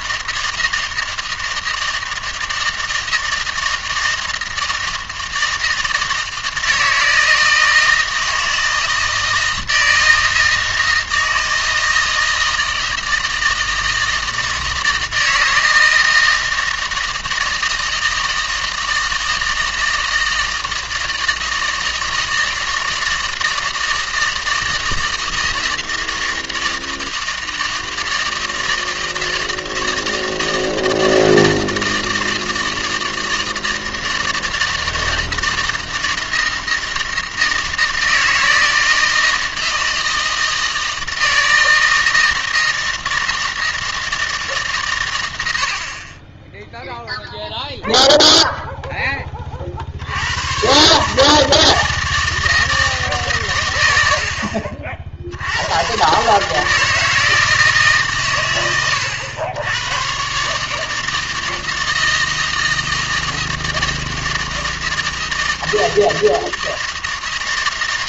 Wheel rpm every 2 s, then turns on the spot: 160, 160, 160, 160, 160, 160, 160, 160, 160, 160, 160, 160, 160, 160, 160, 160, 160, 160, 160, 160, 160, 160, 140, 0, 0, 130, 160, 50, 160, 100, 150, 160, 160, 160.
none